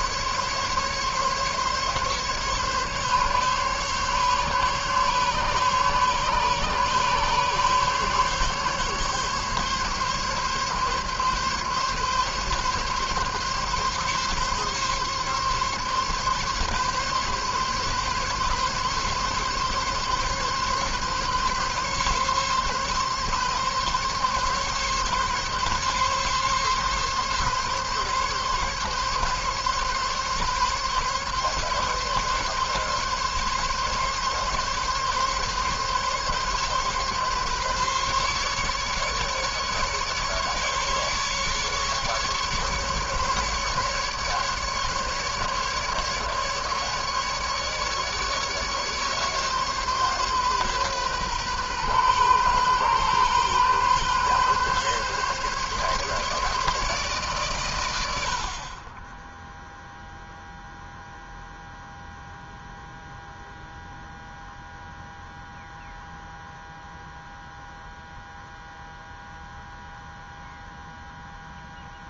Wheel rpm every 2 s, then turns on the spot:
140, 140, 140, 140, 140, 140, 140, 140, 140, 140, 140, 140, 140, 140, 140, 140, 140, 140, 140, 140, 150, 150, 150, 150, 140, 130, 130, 130, 150, 60, 0, 0, 0, 0, 0, 0.
none